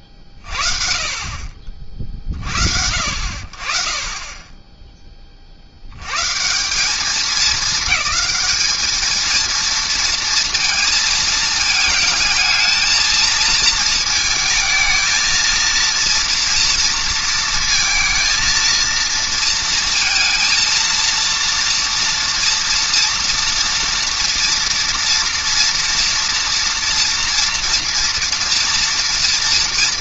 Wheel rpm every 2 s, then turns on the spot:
40, 60, 10, 190, 210, 230, 220, 220, 230, 230, 230, 230, 240, 230, 230.
none